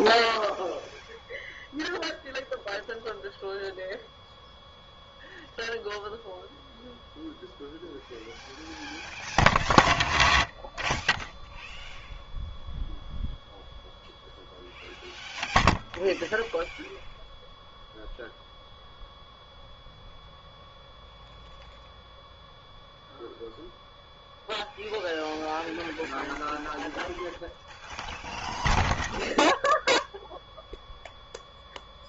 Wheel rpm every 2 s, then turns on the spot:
0, 0, 0, 0, 0, 0, 0, 0, 0, 0, 0, 0, 0, 0, 0, 0.
none